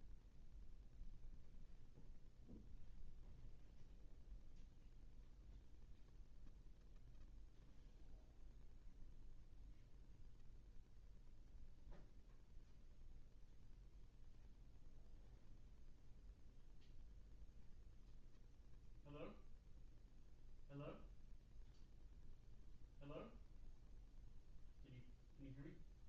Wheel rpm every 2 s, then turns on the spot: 0, 0, 0, 0, 0, 0, 0, 0, 0, 0, 0, 0, 0.
none